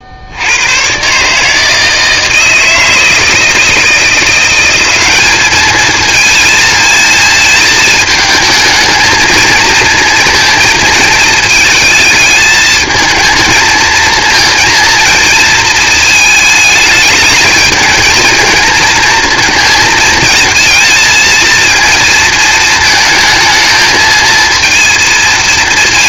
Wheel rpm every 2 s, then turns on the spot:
90, 160, 190, 220, 220, 230, 220, 230, 210, 230, 230, 220, 230.
none